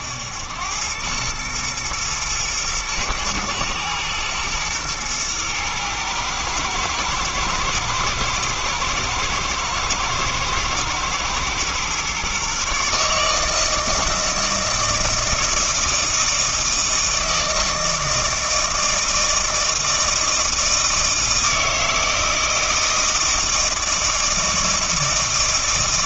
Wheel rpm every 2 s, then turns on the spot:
100, 110, 110, 110, 110, 120, 140, 160, 160, 160, 160, 160, 160.
none